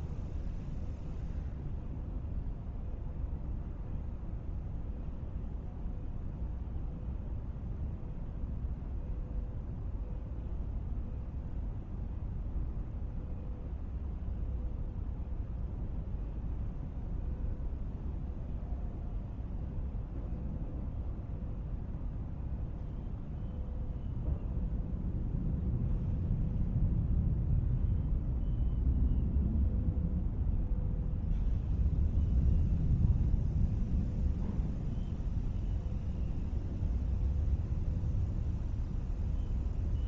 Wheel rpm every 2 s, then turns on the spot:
0, 0, 0, 0, 0, 0, 0, 0, 0, 0, 0, 0, 0, 0, 0, 0, 0, 0, 0, 0.
none